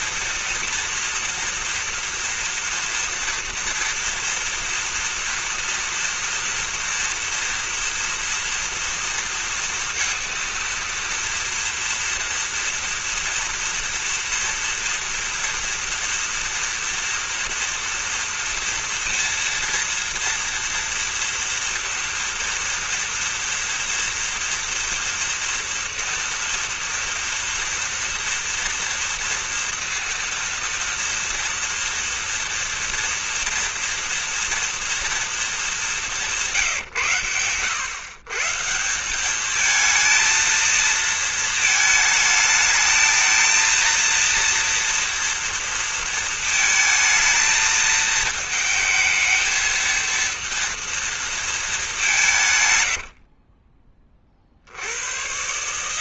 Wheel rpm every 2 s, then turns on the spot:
230, 230, 230, 230, 230, 230, 230, 240, 240, 230, 230, 230, 230, 230, 230, 230, 230, 230, 190, 100, 220, 220, 230, 230, 220, 230, 190, 40.
none